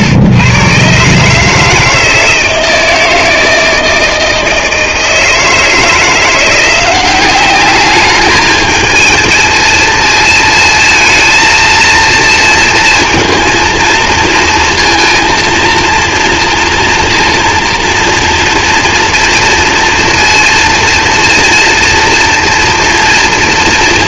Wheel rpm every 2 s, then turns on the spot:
120, 160, 160, 180, 220, 220, 230, 230, 230, 230, 230, 230.
none